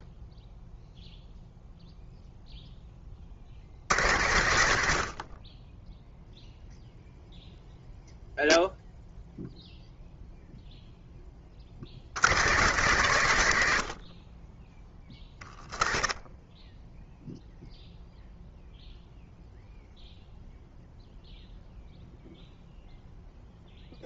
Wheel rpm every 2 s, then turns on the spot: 0, 0, 70, 0, 0, 0, 130, 30, 10, 0, 0, 0.
none